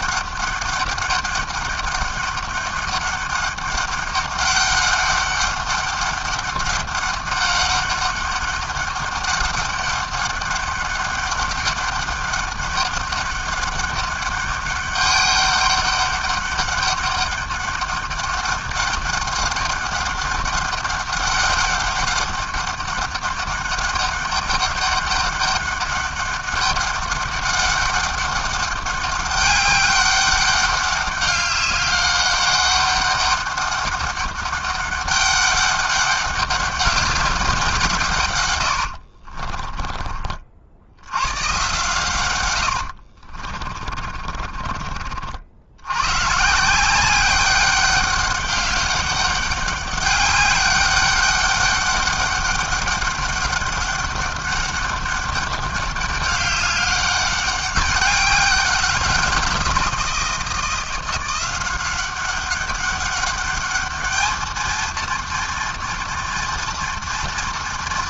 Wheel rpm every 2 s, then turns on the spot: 200, 200, 200, 200, 200, 200, 200, 200, 200, 200, 200, 200, 200, 200, 200, 200, 200, 200, 190, 40, 130, 50, 60, 190, 200, 200, 200, 200, 200, 180, 180, 200, 230, 230.
38-40 42-44